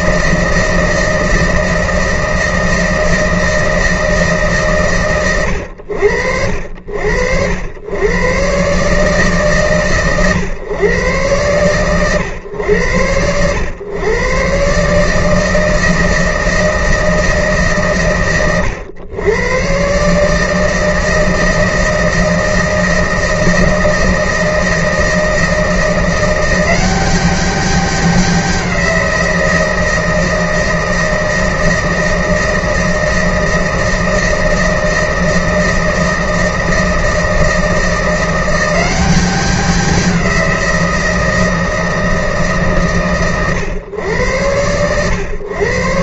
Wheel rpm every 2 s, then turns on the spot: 160, 160, 140, 60, 120, 120, 120, 130, 160, 100, 140, 160, 160, 170, 190, 160, 160, 160, 160, 180, 180, 140, 100.
none